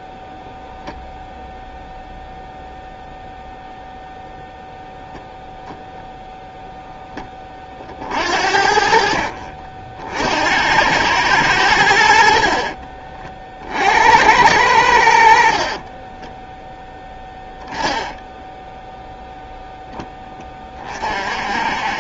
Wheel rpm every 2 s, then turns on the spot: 0, 0, 0, 10, 50, 100, 40, 100, 10, 0, 10.
12-14 16-18